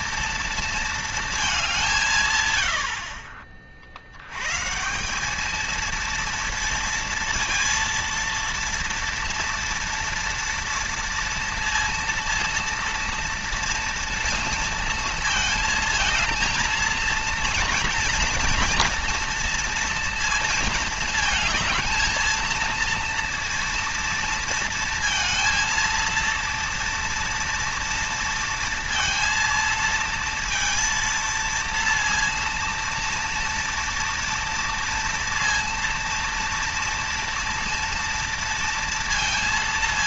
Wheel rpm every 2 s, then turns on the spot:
230, 90, 140, 230, 230, 230, 230, 230, 220, 230, 220, 230, 230, 230, 230, 230, 230, 230, 230, 230.
none